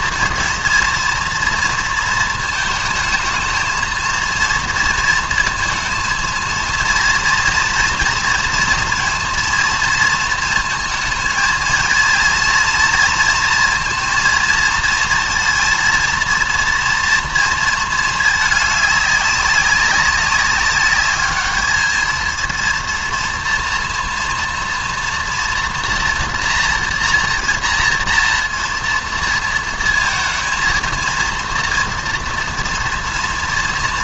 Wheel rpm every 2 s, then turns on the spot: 230, 220, 230, 230, 230, 230, 230, 230, 230, 210, 200, 230, 230, 230, 230, 230, 230.
none